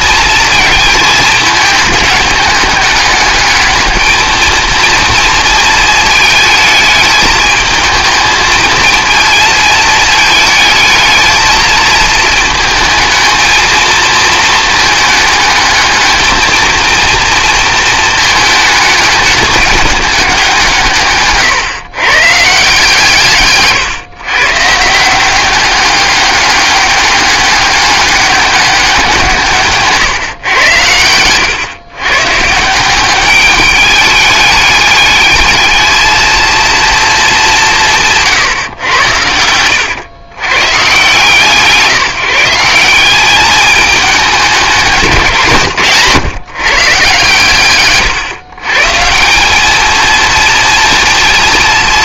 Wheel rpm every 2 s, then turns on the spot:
220, 210, 230, 220, 220, 220, 220, 220, 230, 210, 170, 160, 160, 200, 200, 120, 170, 210, 230, 120, 130, 180, 190, 130, 150, 240.
none